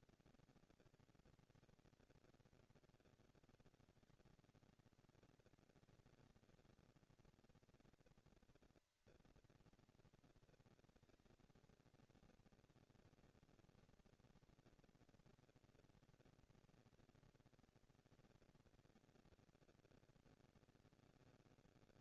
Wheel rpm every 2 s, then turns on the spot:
230, 220, 200, 200, 230, 230, 230, 240, 230, 230, 230.
none